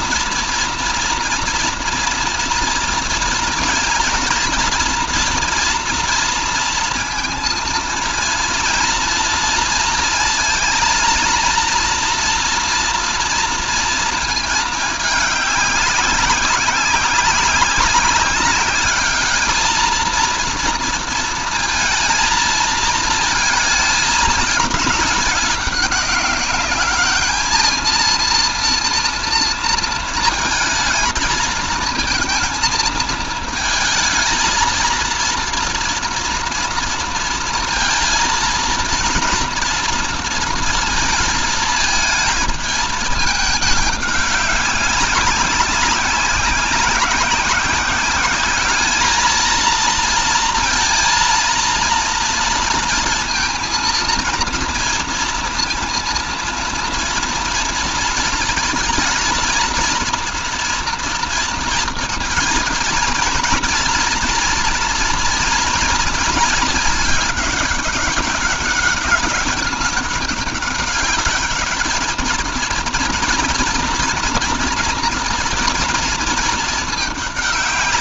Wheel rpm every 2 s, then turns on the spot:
230, 230, 240, 230, 230, 230, 230, 220, 190, 200, 230, 220, 210, 200, 230, 220, 220, 230, 230, 230, 230, 220, 200, 190, 210, 230, 230, 230, 230, 220, 230, 230, 230, 230, 200, 200, 230, 230, 220.
none